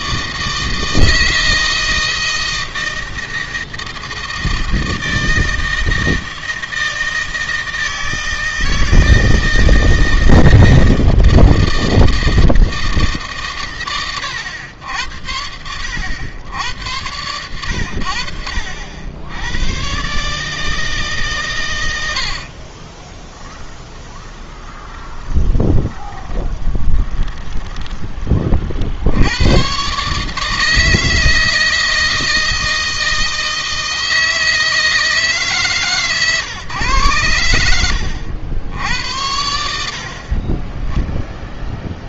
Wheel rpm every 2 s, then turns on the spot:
160, 160, 160, 160, 160, 160, 160, 110, 90, 80, 150, 60, 20, 20, 40, 150, 160, 160, 130, 80, 30.
22-28